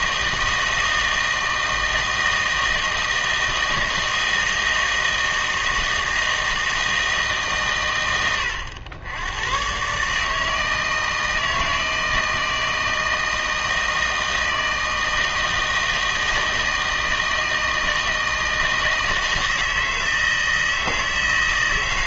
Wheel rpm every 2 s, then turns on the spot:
160, 160, 160, 160, 100, 160, 160, 160, 160, 160, 160.
none